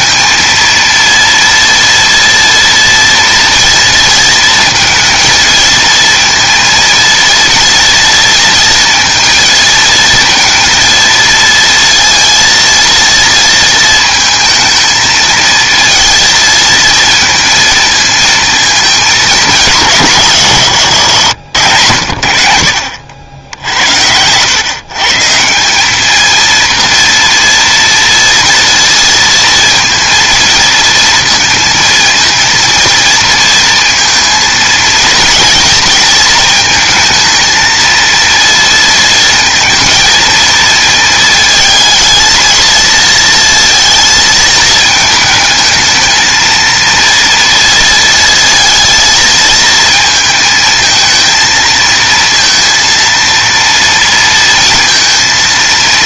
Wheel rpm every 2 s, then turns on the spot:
230, 230, 230, 230, 230, 230, 230, 220, 230, 220, 100, 70, 130, 230, 230, 230, 230, 220, 230, 230, 230, 230, 220, 230, 220, 220, 230, 230.
none